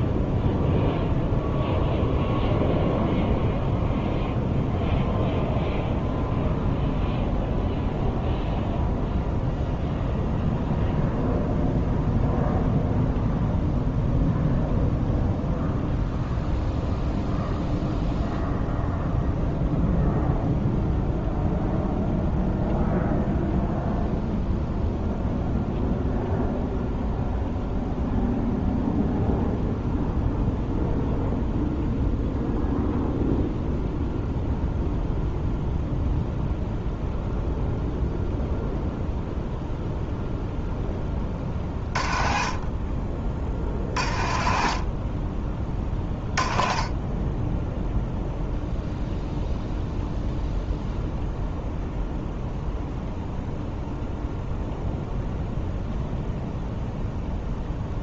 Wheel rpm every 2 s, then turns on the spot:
0, 0, 0, 0, 0, 0, 0, 0, 0, 0, 0, 0, 0, 0, 0, 0, 0, 0, 0, 0, 0, 30, 40, 20, 0, 0, 0, 0, 0.
none